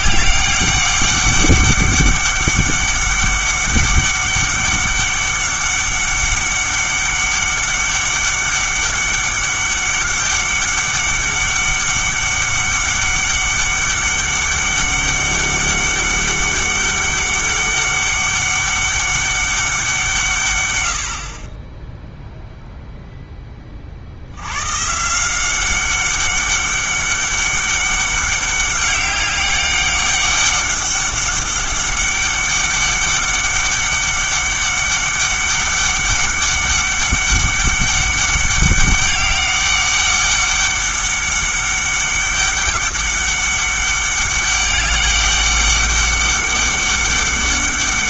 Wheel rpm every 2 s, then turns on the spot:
200, 200, 200, 200, 200, 200, 200, 200, 200, 200, 110, 0, 120, 200, 200, 200, 200, 200, 200, 200, 200, 200, 200, 200.
none